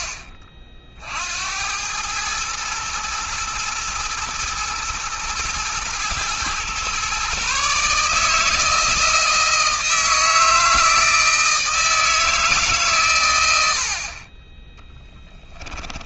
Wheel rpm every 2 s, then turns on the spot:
50, 110, 120, 120, 160, 160, 140, 20.
14-16